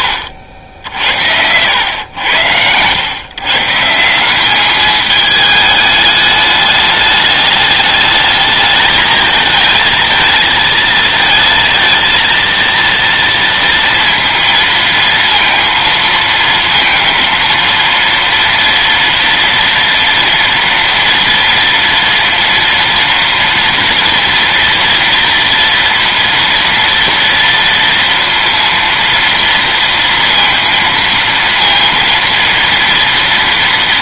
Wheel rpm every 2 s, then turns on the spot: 60, 100, 200, 210, 220, 220, 230, 230, 230, 230, 230, 230, 240, 230, 230, 230, 230.
none